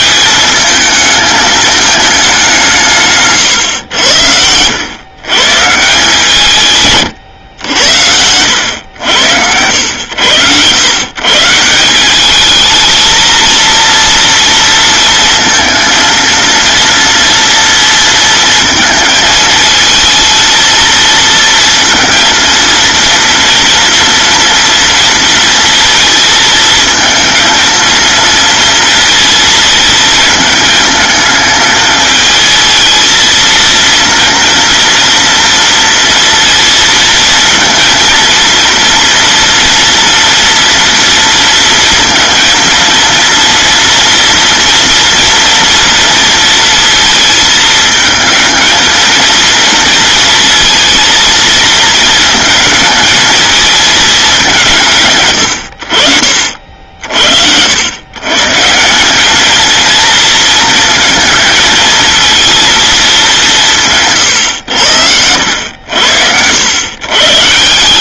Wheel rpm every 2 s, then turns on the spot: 220, 180, 90, 150, 90, 110, 220, 230, 230, 220, 220, 230, 230, 230, 230, 220, 220, 230, 230, 230, 230, 230, 240, 230, 220, 230, 220, 170, 60, 150, 230, 230, 90, 100.
none